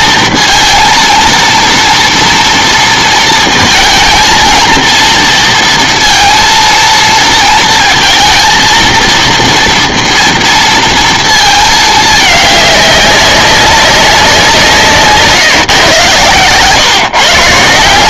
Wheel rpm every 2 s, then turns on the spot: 230, 230, 230, 230, 230, 230, 200, 170, 140.
none